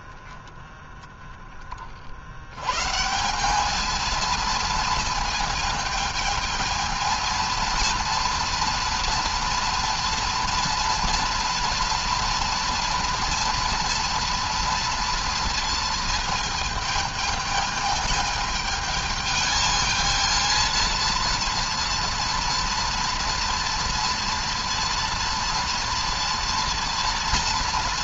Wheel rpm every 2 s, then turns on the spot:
10, 80, 230, 220, 230, 230, 230, 230, 220, 210, 230, 230, 230, 230.
none